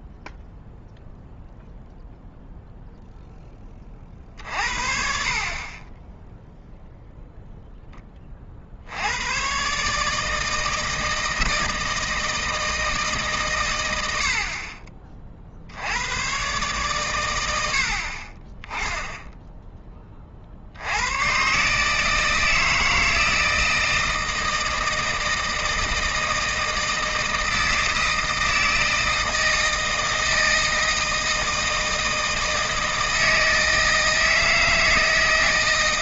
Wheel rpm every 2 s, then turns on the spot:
0, 0, 50, 0, 60, 160, 160, 50, 130, 20, 70, 160, 160, 160, 160, 160, 160, 160.
none